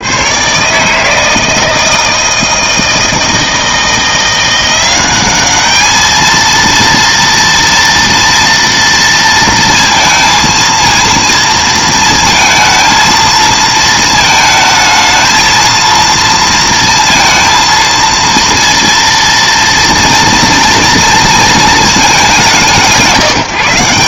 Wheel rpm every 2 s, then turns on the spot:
130, 160, 180, 230, 230, 230, 220, 220, 230, 230, 230, 190.
none